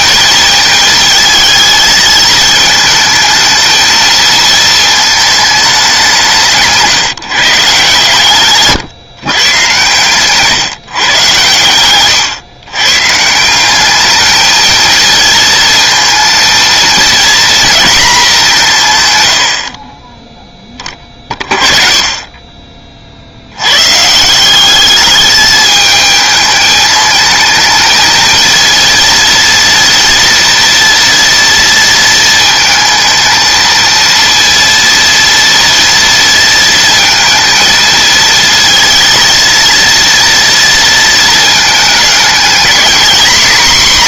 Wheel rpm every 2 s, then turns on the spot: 220, 220, 220, 170, 140, 140, 120, 220, 230, 170, 30, 30, 190, 220, 230, 230, 220, 230, 230, 230, 230, 230.
none